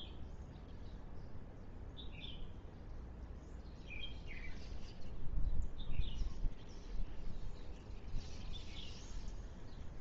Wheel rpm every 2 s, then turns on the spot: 0, 0, 0, 0, 0.
none